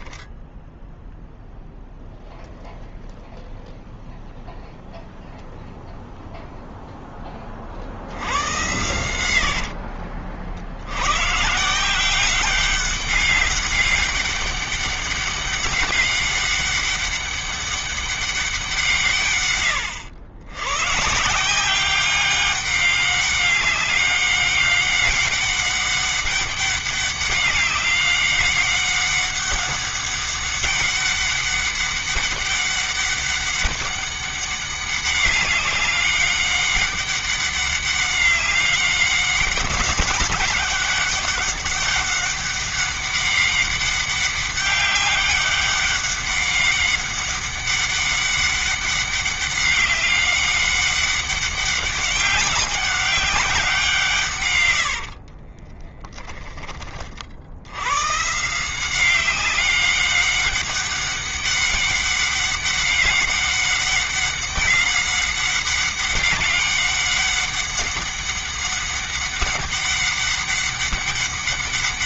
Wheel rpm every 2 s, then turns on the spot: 0, 0, 0, 0, 100, 100, 190, 200, 200, 160, 110, 200, 200, 200, 200, 200, 200, 200, 200, 200, 200, 200, 200, 200, 200, 200, 190, 70, 30, 180, 200, 200, 200, 200, 200, 200.
8-10 54-56